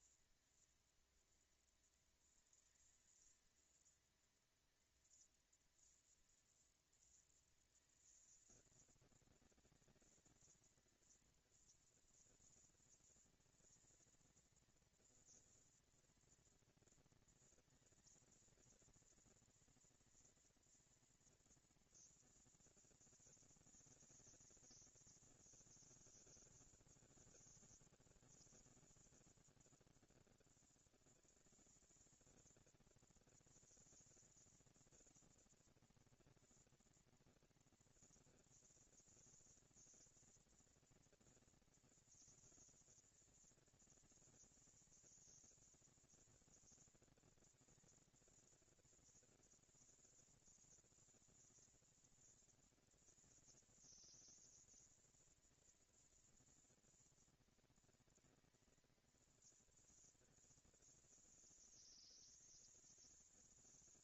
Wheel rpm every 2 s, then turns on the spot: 230, 230, 230, 230, 230, 230, 230, 230, 230, 230, 230, 230, 220, 170, 160, 180, 220, 230, 230, 230, 230, 230, 220, 230, 230, 230, 230, 230, 220, 220, 200, 190.
none